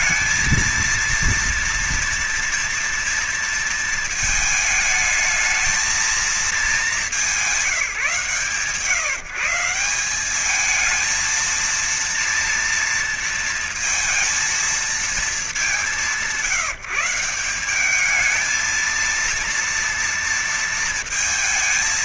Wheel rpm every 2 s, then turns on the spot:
230, 230, 220, 220, 160, 190, 230, 230, 180, 200, 230.
none